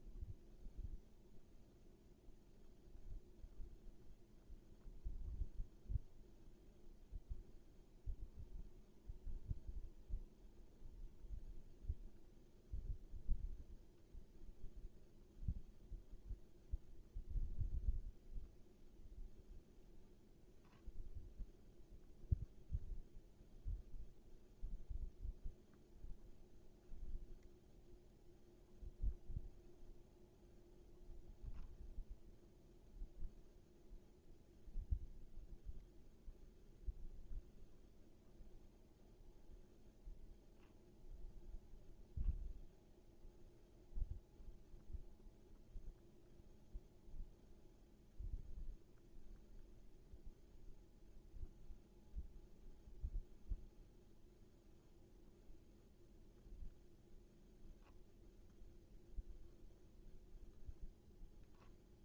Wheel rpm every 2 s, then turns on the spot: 0, 0, 0, 0, 0, 0, 0, 0, 0, 0, 0, 0, 0, 0, 0, 0, 0, 0, 0, 0, 0, 0, 0, 0, 0, 0, 0, 0, 0, 0, 0.
none